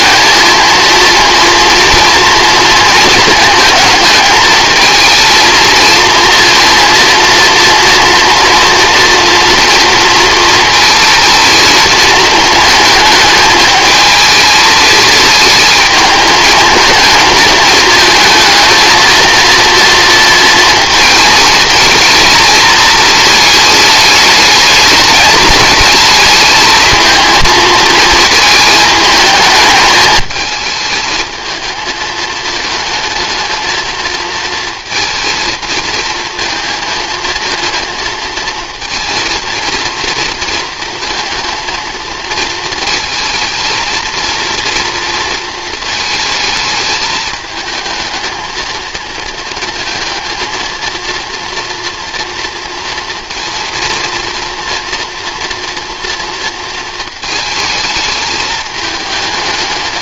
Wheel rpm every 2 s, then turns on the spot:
220, 220, 220, 230, 240, 230, 220, 220, 220, 230, 220, 220, 220, 230, 220, 220, 220, 230, 230, 230, 230, 220, 230, 220, 220, 230, 230, 230, 220, 220.
none